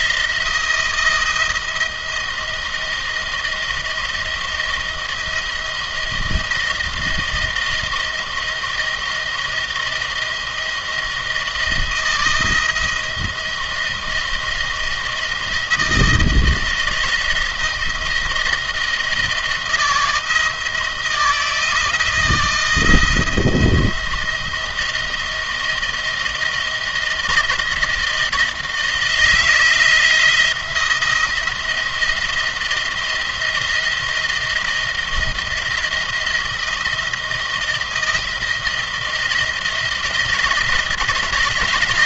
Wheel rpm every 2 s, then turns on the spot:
170, 170, 160, 160, 160, 170, 160, 160, 160, 170, 170, 170, 170, 170, 170, 170, 170, 170, 170, 160, 170.
none